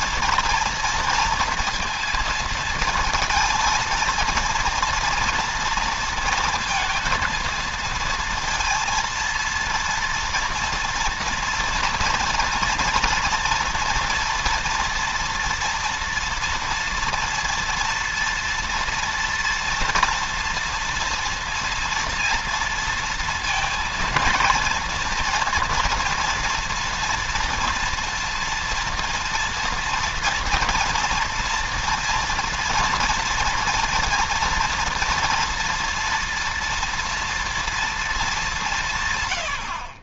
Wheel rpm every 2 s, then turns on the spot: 230, 230, 230, 230, 230, 230, 240, 230, 230, 230, 230, 230, 230, 230, 230, 230, 230, 230, 240, 170.
none